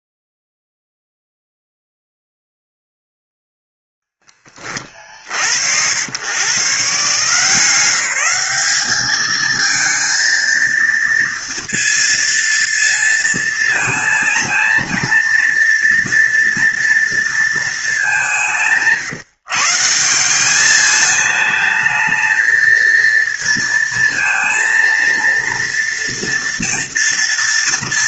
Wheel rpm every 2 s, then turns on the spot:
0, 0, 30, 150, 210, 230, 230, 230, 230, 150, 210, 230, 230, 230.
none